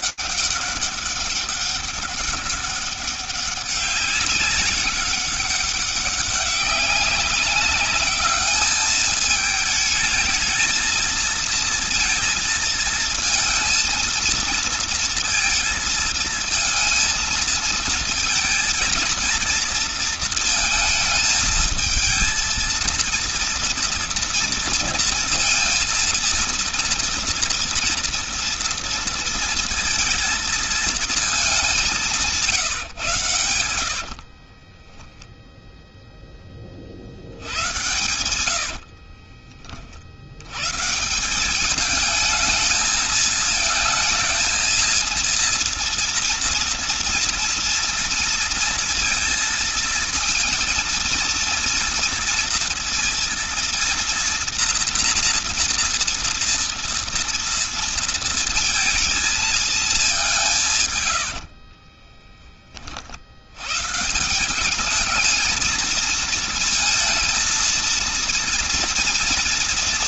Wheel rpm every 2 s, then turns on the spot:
200, 200, 200, 190, 210, 220, 220, 230, 230, 230, 220, 230, 230, 230, 230, 220, 140, 10, 60, 50, 150, 220, 230, 230, 230, 230, 230, 240, 230, 230, 130, 60, 210, 230, 230.
34-36 38-40 60-62